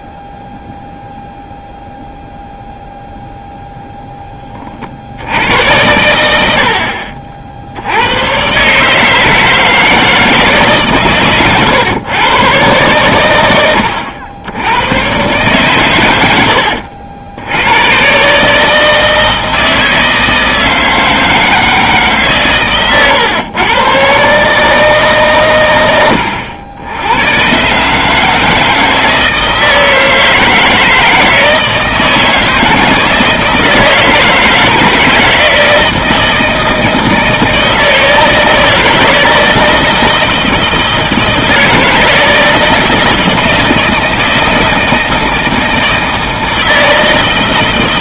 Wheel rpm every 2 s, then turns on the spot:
0, 0, 30, 80, 130, 150, 120, 80, 90, 150, 160, 130, 150, 80, 160, 160, 160, 170, 160, 160, 160, 160, 160, 160.
none